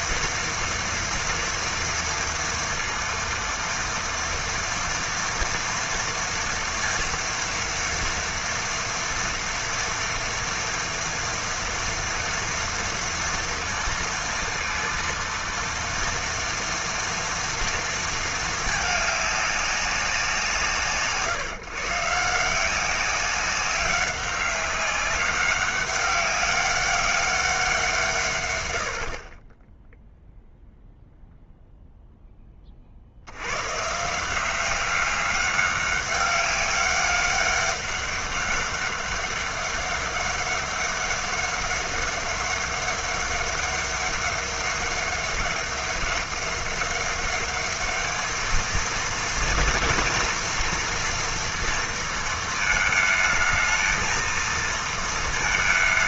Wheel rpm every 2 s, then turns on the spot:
230, 230, 230, 230, 240, 230, 230, 230, 230, 220, 160, 180, 200, 200, 180, 0, 40, 190, 200, 200, 200, 200, 200, 200, 220, 230, 220, 230.
none